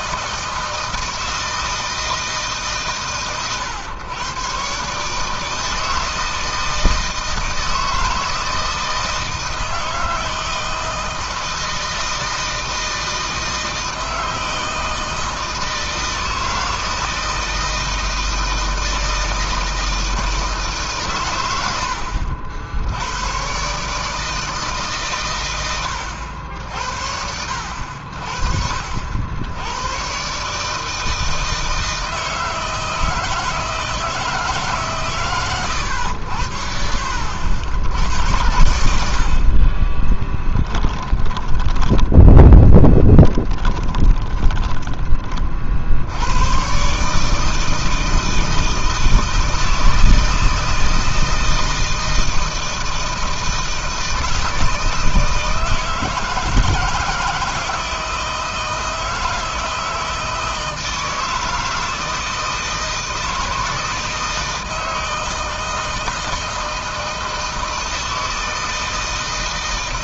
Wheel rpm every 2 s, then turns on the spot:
160, 150, 130, 160, 160, 160, 160, 160, 160, 160, 150, 70, 160, 80, 60, 140, 160, 160, 80, 90, 20, 10, 10, 100, 160, 160, 160, 160, 160, 160, 160, 160, 160, 160, 160.
40-46